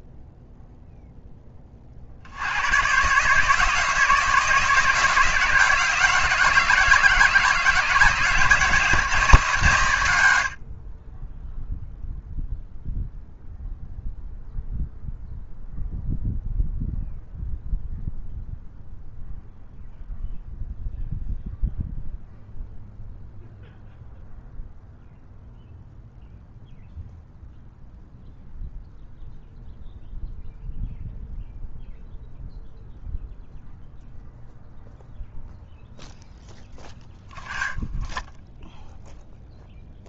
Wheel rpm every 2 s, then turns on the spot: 0, 120, 160, 170, 180, 60, 0, 0, 0, 0, 0, 0, 0, 0, 0, 0, 0, 0, 0, 0.
none